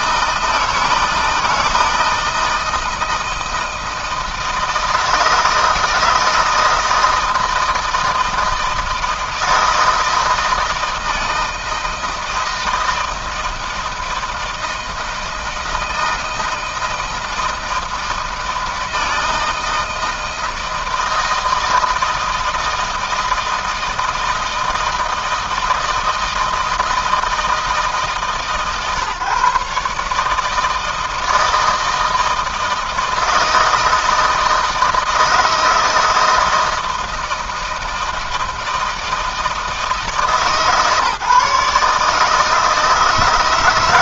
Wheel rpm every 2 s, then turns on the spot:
160, 170, 160, 160, 160, 160, 160, 160, 160, 160, 160, 160, 160, 160, 140, 160, 160, 160, 160, 160, 150, 160.
none